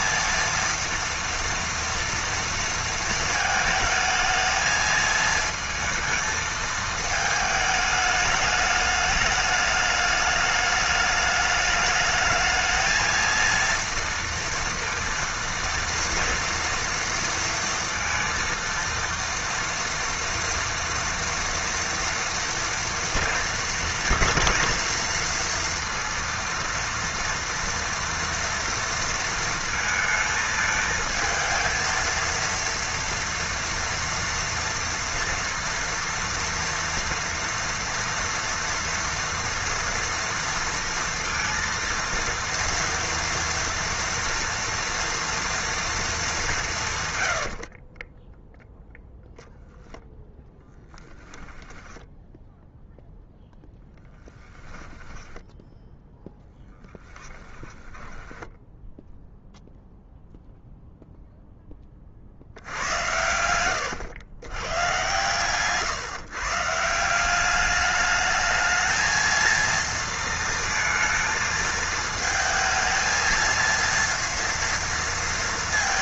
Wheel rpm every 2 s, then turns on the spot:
230, 230, 220, 220, 210, 210, 220, 230, 230, 230, 230, 230, 230, 230, 230, 220, 230, 230, 230, 230, 230, 230, 230, 150, 0, 10, 0, 10, 10, 10, 0, 80, 120, 160, 220, 230, 220, 230.
50-52 54-58